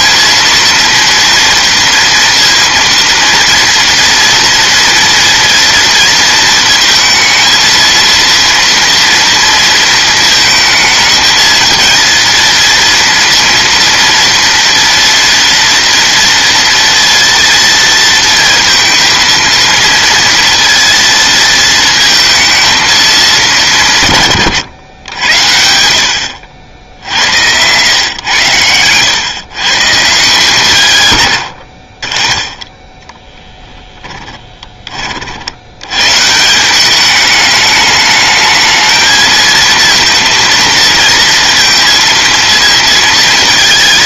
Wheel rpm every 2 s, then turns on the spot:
230, 230, 230, 230, 230, 230, 230, 230, 230, 230, 230, 230, 120, 70, 110, 160, 0, 20, 180, 220, 230, 230.
28-30